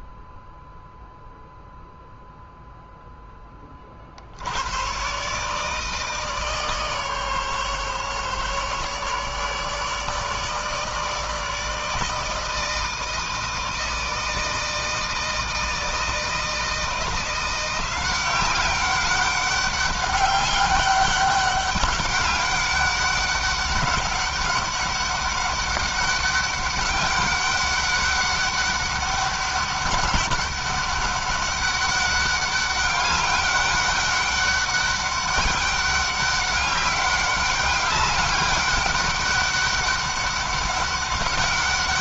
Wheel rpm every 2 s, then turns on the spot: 0, 0, 110, 150, 140, 160, 160, 160, 170, 190, 200, 200, 200, 200, 200, 200, 200, 200, 200, 200, 200.
none